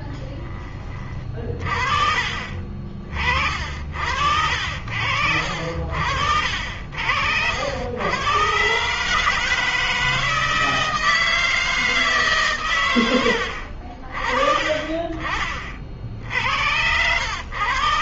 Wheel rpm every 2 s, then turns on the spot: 20, 40, 60, 60, 130, 160, 120, 30, 80.
none